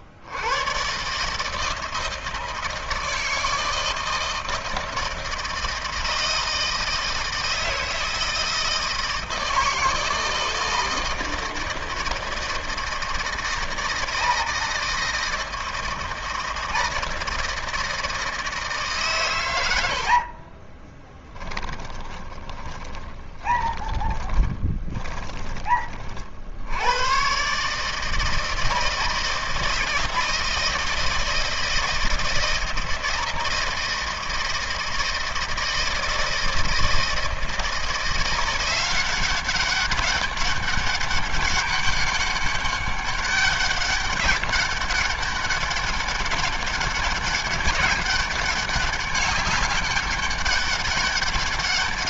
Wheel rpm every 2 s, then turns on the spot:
90, 160, 160, 160, 160, 160, 160, 160, 160, 160, 50, 10, 20, 70, 160, 160, 160, 160, 160, 170, 200, 200, 190, 200, 200, 200.
20-26